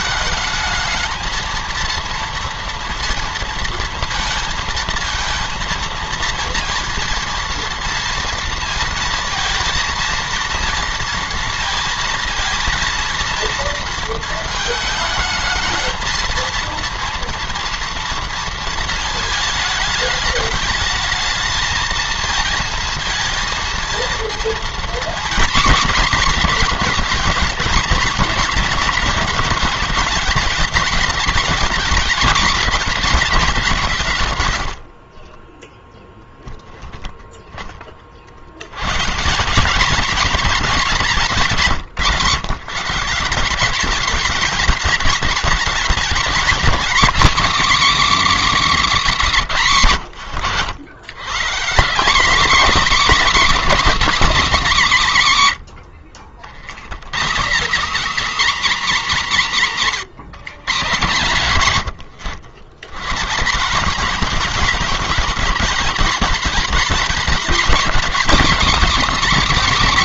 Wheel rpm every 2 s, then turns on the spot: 220, 230, 230, 230, 230, 230, 230, 220, 230, 220, 210, 230, 230, 220, 210, 220, 220, 80, 10, 110, 220, 150, 210, 230, 260, 110, 280, 230, 110, 270, 160, 130, 220, 230, 220.
34-36